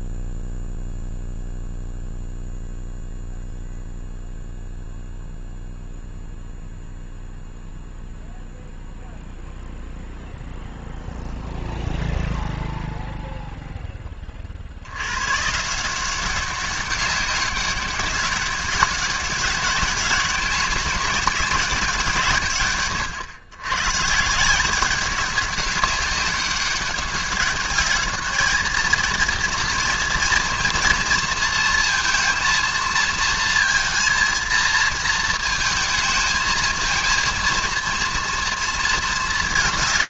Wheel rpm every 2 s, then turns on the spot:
0, 0, 0, 0, 0, 0, 0, 40, 190, 190, 200, 150, 160, 200, 220, 230, 230, 230, 220, 230.
none